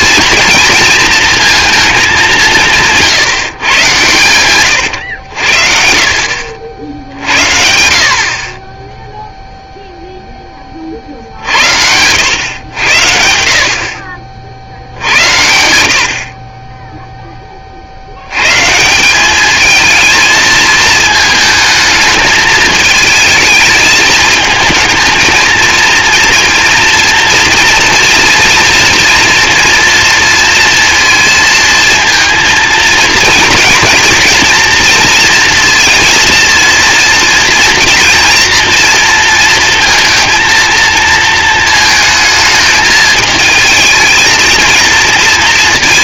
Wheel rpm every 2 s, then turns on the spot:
230, 170, 110, 70, 10, 30, 90, 70, 10, 150, 220, 220, 220, 230, 230, 230, 230, 230, 230, 240, 230, 220, 220.
none